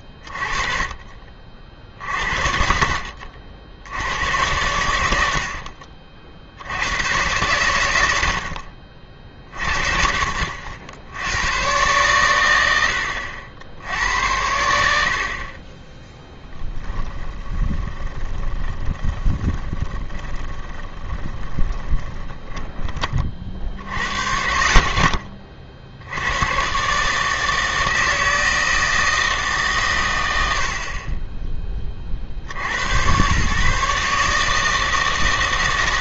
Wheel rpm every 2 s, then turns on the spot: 30, 60, 100, 80, 70, 60, 80, 90, 20, 20, 20, 30, 40, 120, 160, 70, 80, 160.
16-24